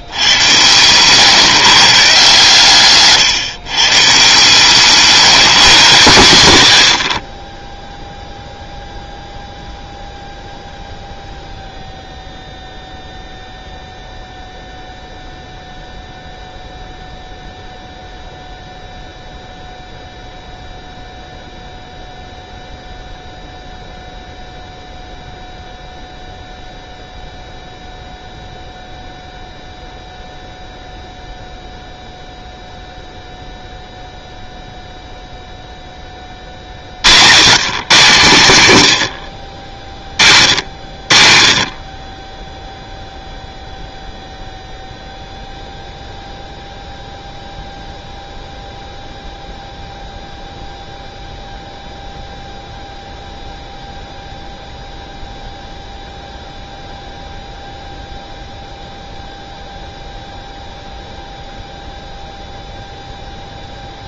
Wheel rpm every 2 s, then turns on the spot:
110, 140, 150, 170, 0, 0, 0, 0, 0, 0, 0, 0, 0, 0, 0, 0, 0, 0, 40, 130, 60, 10, 0, 0, 0, 0, 0, 0, 0, 0, 0, 0.
none